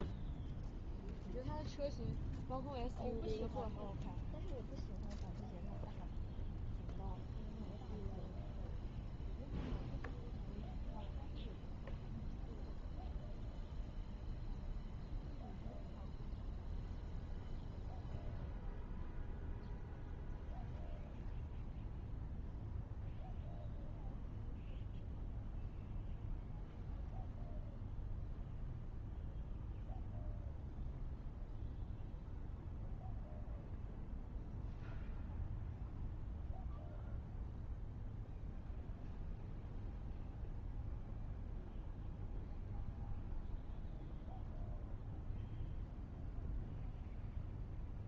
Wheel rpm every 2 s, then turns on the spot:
0, 0, 0, 0, 0, 0, 0, 0, 0, 0, 0, 0, 0, 0, 0, 0, 0, 0, 0, 0, 0, 0, 0, 0.
none